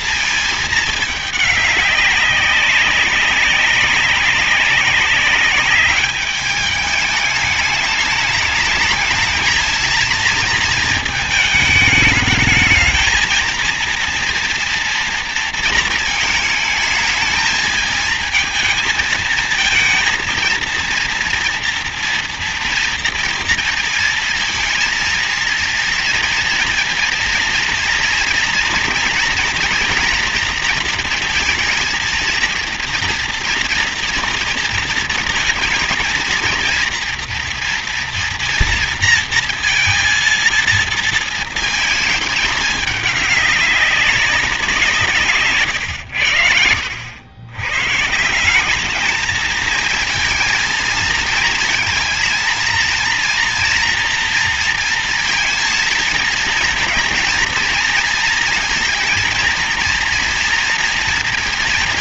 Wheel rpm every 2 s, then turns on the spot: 220, 200, 190, 210, 210, 230, 220, 230, 220, 220, 230, 230, 220, 230, 230, 230, 230, 230, 230, 240, 230, 220, 180, 90, 180, 230, 230, 230, 230, 230, 230.
none